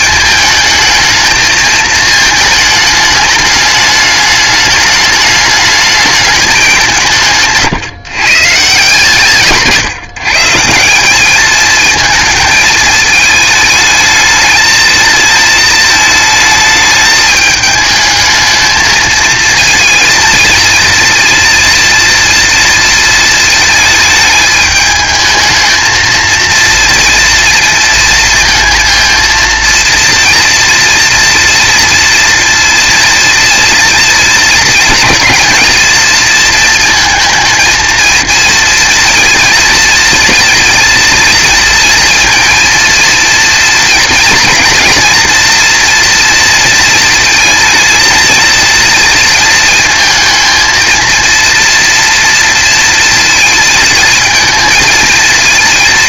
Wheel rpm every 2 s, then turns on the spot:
220, 210, 210, 190, 150, 190, 220, 220, 210, 220, 230, 230, 220, 230, 230, 230, 230, 230, 230, 230, 230, 230, 230, 230, 230, 230, 230, 220.
none